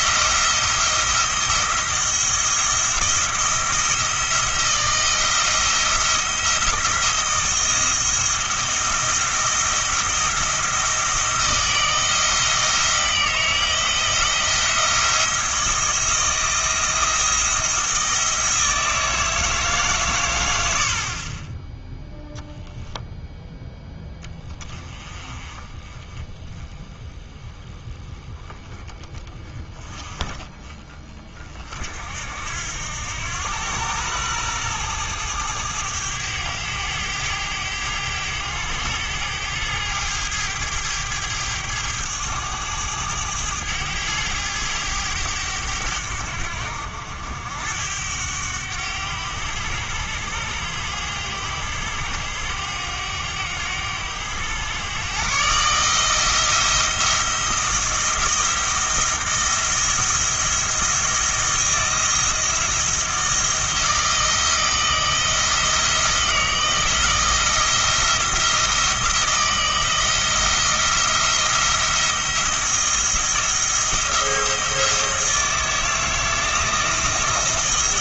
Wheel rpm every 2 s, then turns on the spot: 170, 170, 170, 170, 170, 170, 160, 170, 170, 160, 80, 0, 20, 20, 20, 30, 80, 110, 100, 100, 110, 100, 100, 80, 100, 100, 100, 110, 170, 170, 170, 170, 170, 170, 170, 170, 170, 170, 160.
none